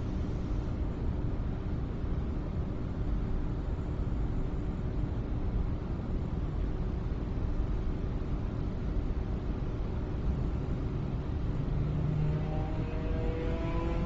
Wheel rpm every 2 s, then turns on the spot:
0, 0, 0, 0, 0, 0, 0.
none